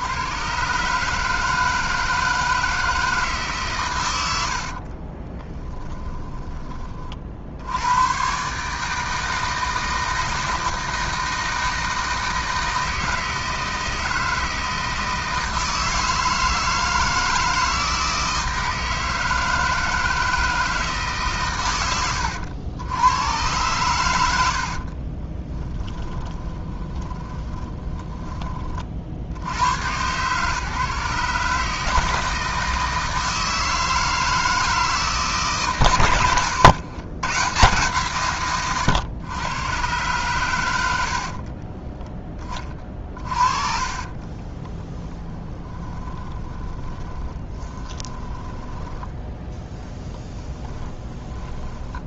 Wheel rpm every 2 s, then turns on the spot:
140, 160, 50, 30, 150, 160, 160, 160, 160, 160, 160, 90, 40, 20, 30, 140, 160, 160, 110, 120, 90, 30, 30, 20, 10, 10.
4-6 24-28 42-52